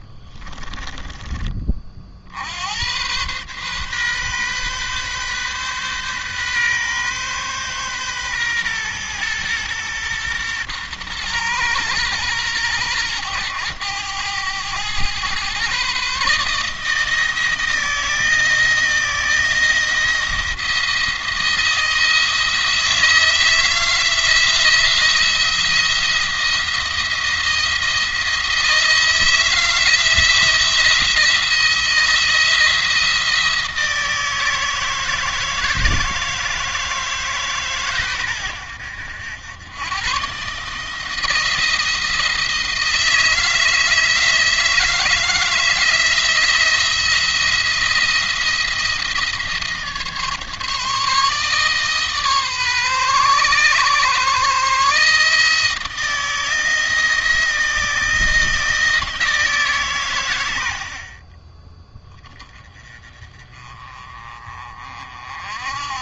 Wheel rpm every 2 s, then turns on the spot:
30, 100, 130, 130, 120, 120, 110, 110, 160, 160, 170, 160, 170, 170, 160, 170, 170, 160, 160, 90, 150, 160, 160, 170, 160, 150, 130, 150, 160, 160, 50, 20, 40.
0-2